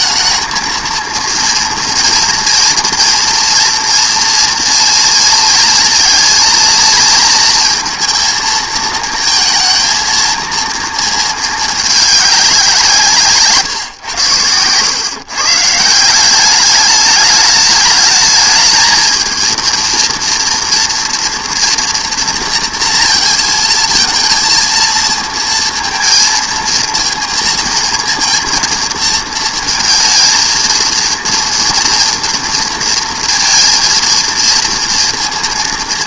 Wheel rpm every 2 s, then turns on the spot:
220, 230, 230, 230, 230, 230, 200, 110, 200, 220, 230, 230, 230, 220, 230, 220, 230, 230.
none